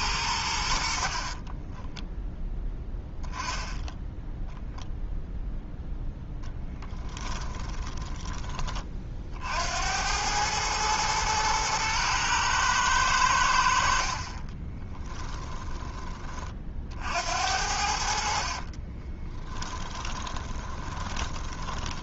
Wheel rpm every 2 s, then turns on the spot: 70, 10, 0, 10, 20, 110, 110, 20, 50, 30, 20.
6-8 14-16 18-22